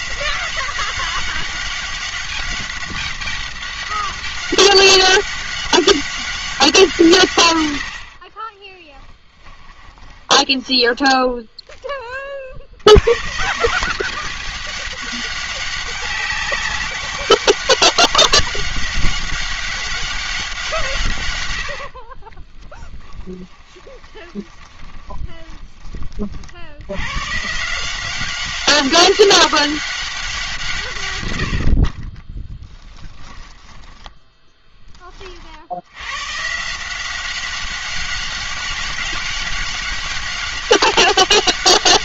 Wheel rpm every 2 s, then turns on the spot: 190, 200, 190, 180, 20, 10, 60, 200, 200, 200, 180, 20, 20, 70, 190, 170, 10, 10, 150, 200, 200.
8-12 22-26 32-34